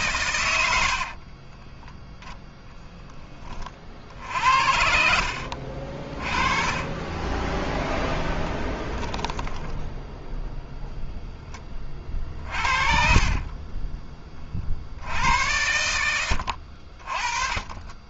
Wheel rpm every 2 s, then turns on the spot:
70, 10, 80, 30, 10, 0, 50, 50, 70.
0-2 4-10 12-14